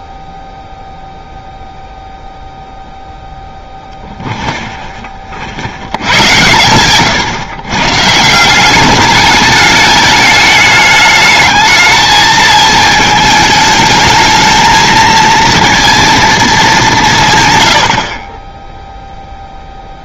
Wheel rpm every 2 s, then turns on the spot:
0, 0, 0, 120, 180, 210, 220, 220, 200, 10.
none